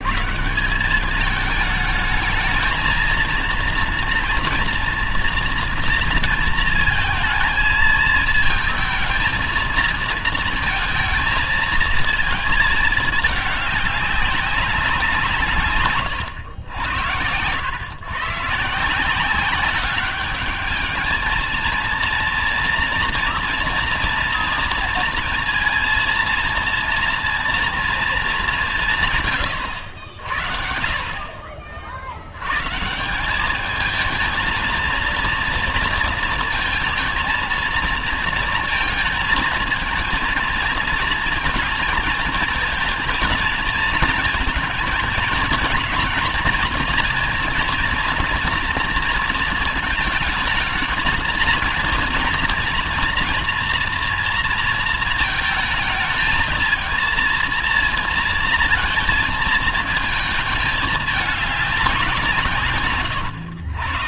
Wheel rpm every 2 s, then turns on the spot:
160, 220, 240, 230, 220, 230, 220, 190, 100, 150, 200, 230, 230, 230, 190, 70, 110, 220, 220, 230, 230, 230, 220, 230, 230, 220, 230, 230, 220, 230, 220, 150.
62-64